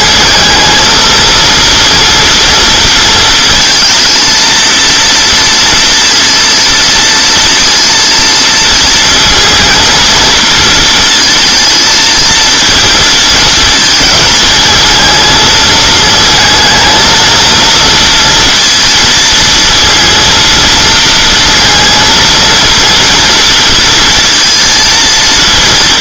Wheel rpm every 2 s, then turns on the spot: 220, 230, 230, 230, 230, 230, 230, 230, 220, 230, 230, 230, 230.
none